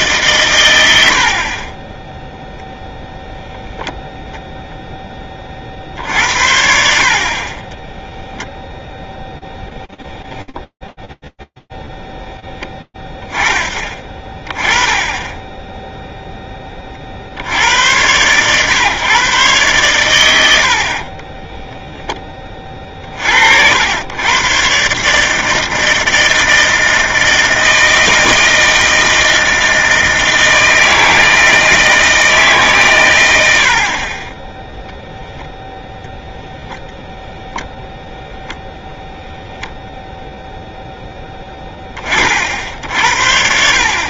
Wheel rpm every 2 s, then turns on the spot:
120, 0, 0, 50, 0, 10, 0, 20, 20, 120, 70, 30, 130, 160, 160, 160, 140, 0, 0, 0, 20, 60.
none